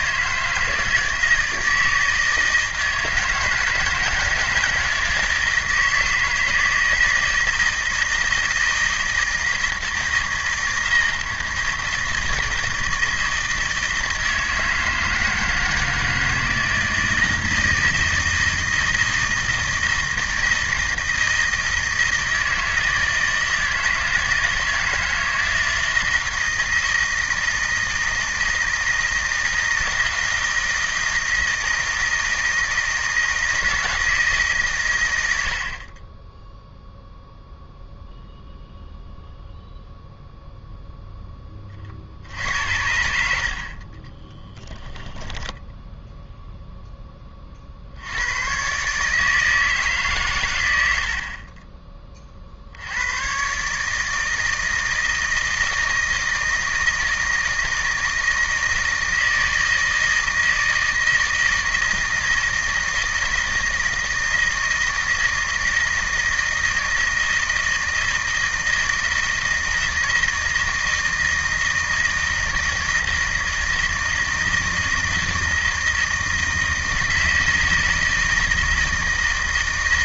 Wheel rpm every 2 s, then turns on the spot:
160, 160, 160, 160, 160, 160, 160, 160, 160, 170, 160, 160, 160, 160, 160, 160, 160, 110, 0, 0, 0, 70, 10, 10, 140, 80, 80, 160, 160, 160, 160, 160, 160, 160, 160, 160, 160, 160, 160, 160.
44-46